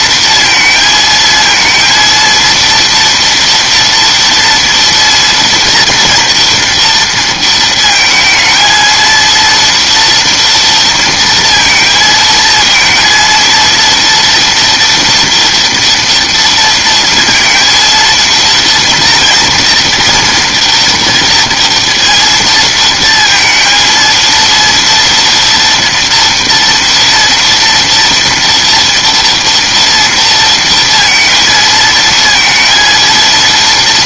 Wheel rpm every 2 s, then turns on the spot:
230, 230, 230, 230, 220, 230, 230, 230, 230, 230, 240, 230, 230, 240, 230, 230, 230.
none